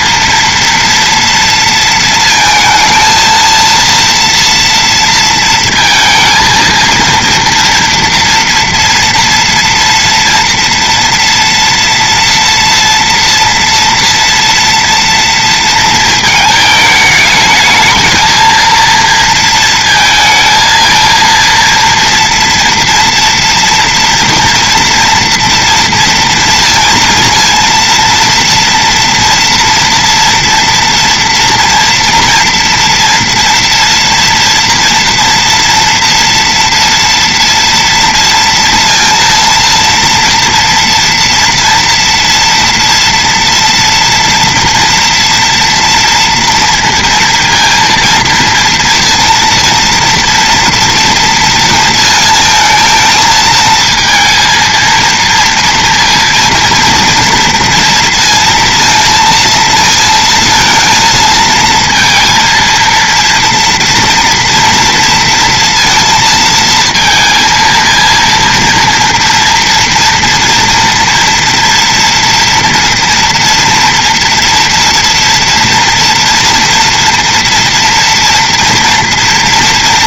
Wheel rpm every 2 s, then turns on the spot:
240, 230, 230, 230, 240, 230, 230, 230, 220, 230, 230, 230, 230, 230, 230, 240, 230, 230, 230, 230, 230, 230, 240, 240, 230, 230, 220, 230, 230, 230, 230, 230, 230, 230, 230, 230, 230, 230, 230, 230.
none